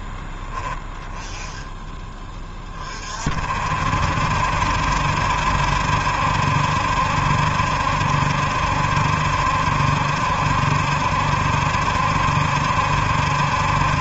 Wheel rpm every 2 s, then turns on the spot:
30, 70, 70, 70, 70, 70, 50.
none